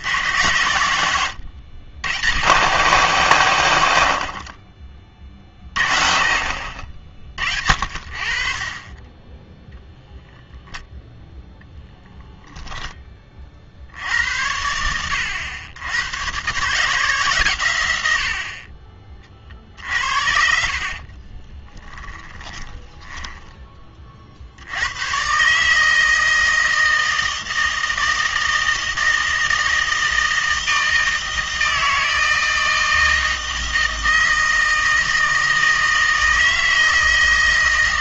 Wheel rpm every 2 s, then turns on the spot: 120, 160, 50, 50, 40, 0, 0, 80, 140, 60, 60, 20, 80, 160, 160, 160, 160, 160, 160.
20-24